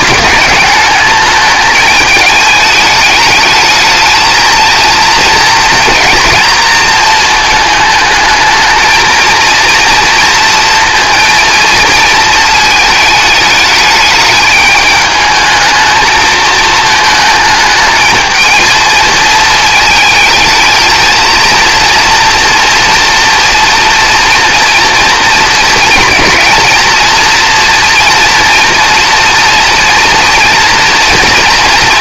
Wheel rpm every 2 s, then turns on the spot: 210, 210, 220, 230, 220, 230, 220, 210, 220, 220, 220, 230, 240, 230, 240, 230.
none